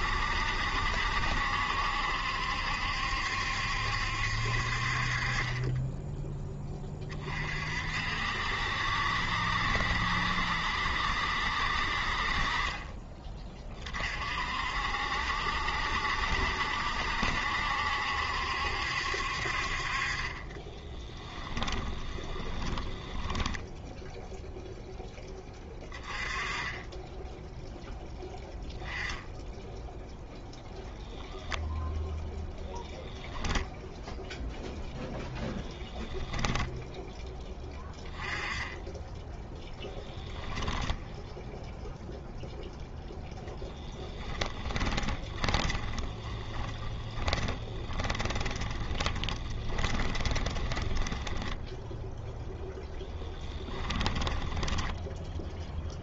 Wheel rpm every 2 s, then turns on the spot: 70, 70, 50, 20, 60, 70, 30, 60, 70, 70, 10, 20, 0, 10, 10, 0, 0, 10, 10, 10, 10, 0, 20, 20, 20, 10, 10, 10.
12-14 20-24 34-38 40-42 44-52 54-56